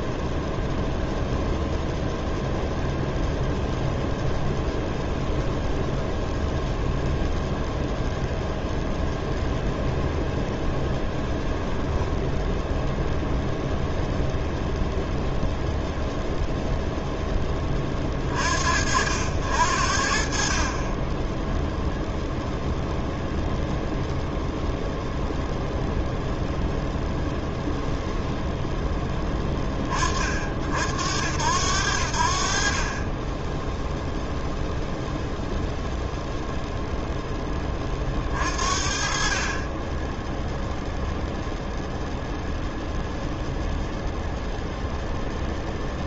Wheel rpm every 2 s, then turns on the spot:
0, 0, 0, 0, 0, 0, 0, 0, 0, 70, 20, 0, 0, 0, 0, 50, 40, 0, 0, 30, 0, 0, 0.
none